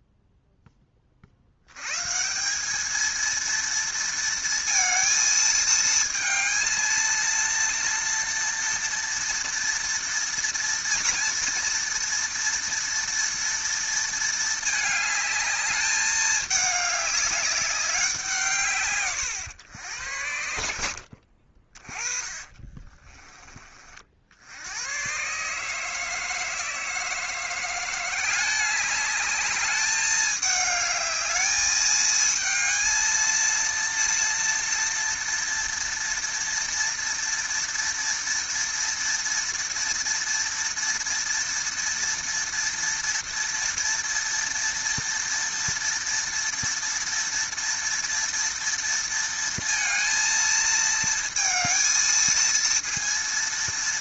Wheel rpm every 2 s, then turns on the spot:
0, 150, 230, 220, 230, 240, 230, 220, 210, 170, 90, 20, 70, 160, 190, 210, 220, 230, 230, 230, 230, 230, 230, 230, 230, 230, 230.
22-24